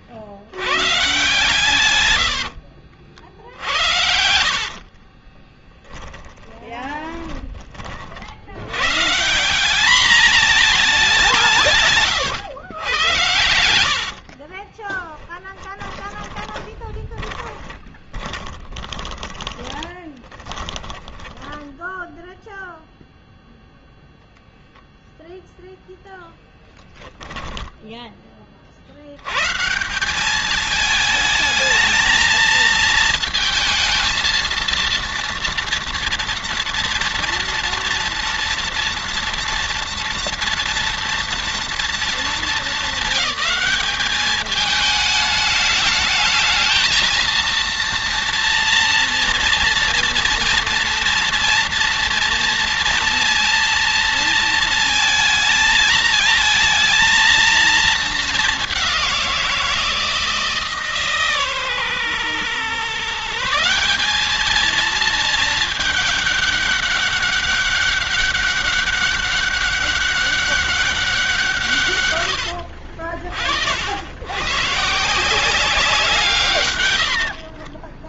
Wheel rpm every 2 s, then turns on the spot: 120, 70, 50, 20, 120, 200, 100, 20, 20, 20, 20, 0, 0, 10, 70, 220, 230, 230, 230, 230, 230, 220, 210, 220, 230, 240, 230, 220, 220, 190, 150, 140, 220, 200, 200, 190, 60, 140, 130.
4-8 14-22 26-28 76-78